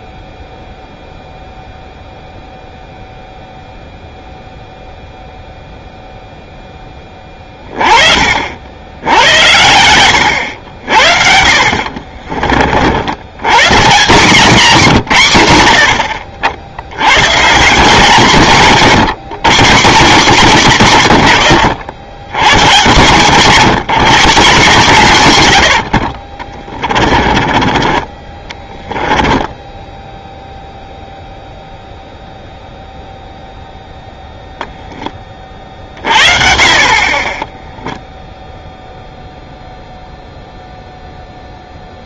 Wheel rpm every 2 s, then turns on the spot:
0, 0, 0, 10, 60, 80, 40, 170, 70, 140, 160, 140, 170, 30, 20, 0, 0, 0, 40, 0, 0.
26-30